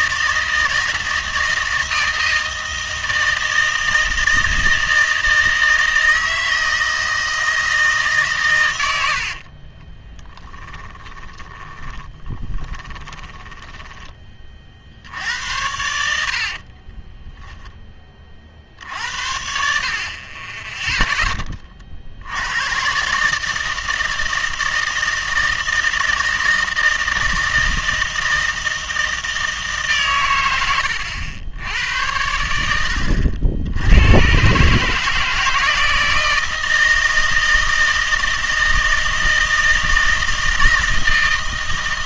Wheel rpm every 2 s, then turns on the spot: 160, 160, 160, 160, 110, 20, 20, 40, 50, 60, 10, 110, 160, 160, 160, 100, 90, 130, 160, 160, 160.
10-14 16-18